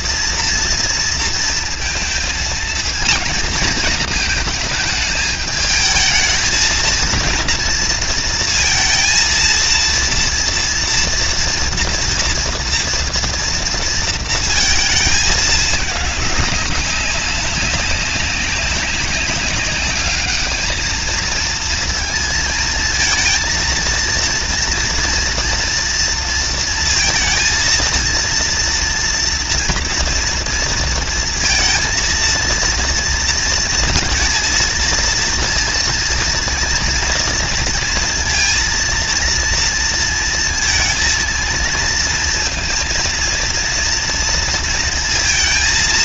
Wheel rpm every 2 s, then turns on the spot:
230, 230, 220, 210, 230, 230, 230, 230, 220, 190, 200, 220, 230, 230, 230, 230, 230, 230, 230, 230, 230, 230, 230.
none